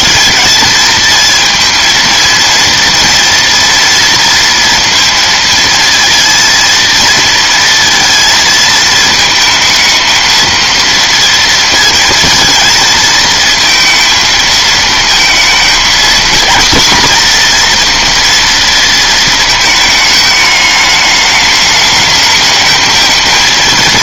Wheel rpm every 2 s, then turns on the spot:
220, 230, 230, 220, 220, 230, 230, 220, 240, 230, 210, 220.
none